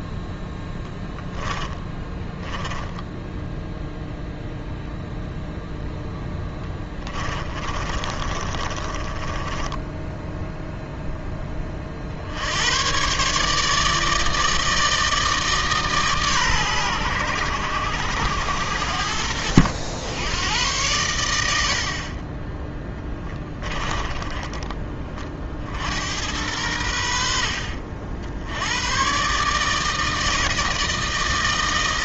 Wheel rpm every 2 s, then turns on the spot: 10, 10, 0, 20, 20, 10, 120, 160, 110, 80, 110, 10, 30, 90, 110, 160.
0-4 6-10